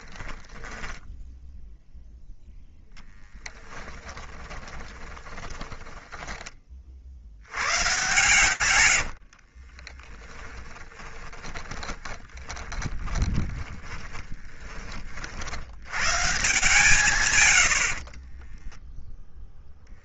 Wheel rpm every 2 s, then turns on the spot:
10, 0, 20, 50, 100, 10, 20, 30, 140, 10.
0-2 4-6 8-14